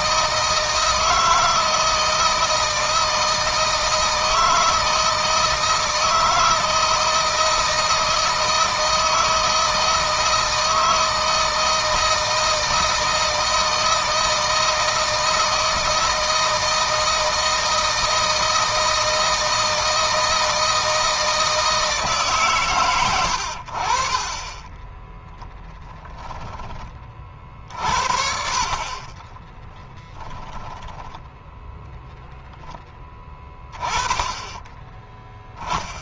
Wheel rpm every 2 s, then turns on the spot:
160, 160, 160, 160, 160, 160, 160, 160, 160, 160, 160, 110, 10, 30, 40, 0, 10, 20.
28-30